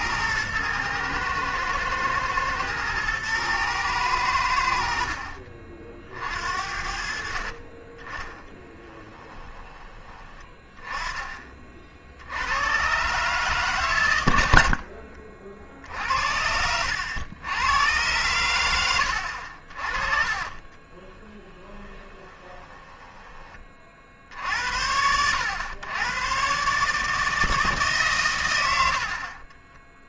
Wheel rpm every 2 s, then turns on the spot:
110, 120, 70, 60, 10, 20, 100, 60, 70, 90, 30, 20, 80, 130, 80.
8-10 14-16 20-24